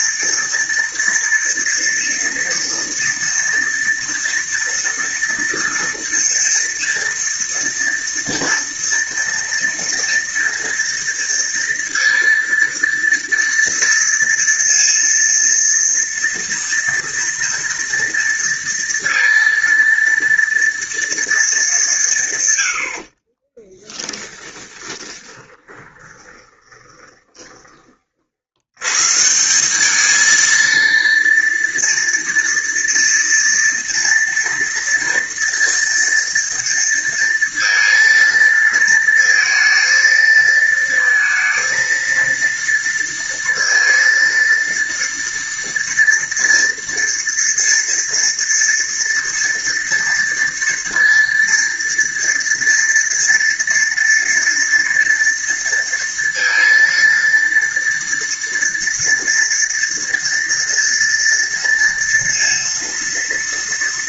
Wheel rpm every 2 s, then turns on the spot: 230, 230, 230, 230, 240, 230, 230, 230, 230, 230, 230, 70, 10, 10, 110, 230, 230, 230, 230, 230, 230, 230, 230, 230, 230, 230, 230, 230, 230, 230, 230, 230.
24-28